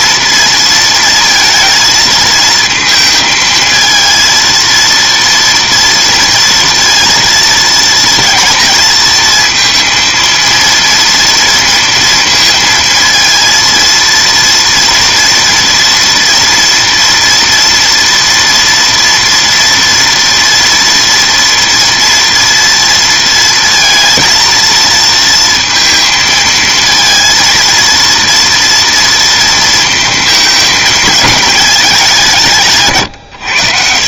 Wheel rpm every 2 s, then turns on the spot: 230, 230, 230, 230, 230, 230, 230, 230, 230, 230, 230, 230, 230, 230, 230, 220, 160.
none